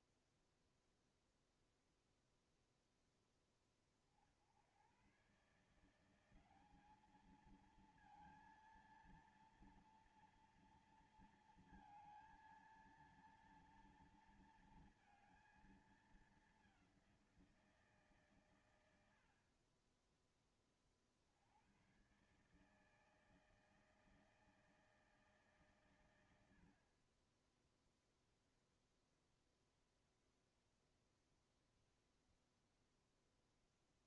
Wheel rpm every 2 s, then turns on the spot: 0, 0, 60, 180, 230, 230, 230, 230, 210, 140, 20, 130, 160, 90, 0, 0, 0.
none